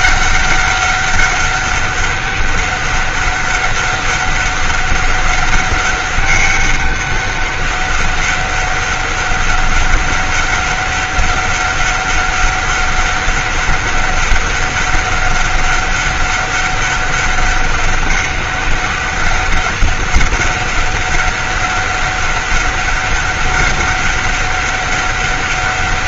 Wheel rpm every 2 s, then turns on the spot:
200, 200, 200, 200, 200, 200, 200, 200, 200, 200, 200, 200, 200.
none